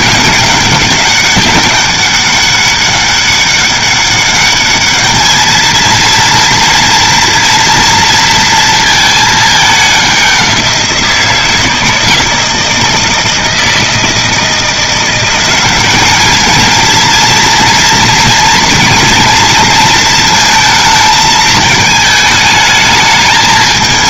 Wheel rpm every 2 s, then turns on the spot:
190, 200, 210, 230, 230, 180, 160, 160, 220, 230, 220, 210.
none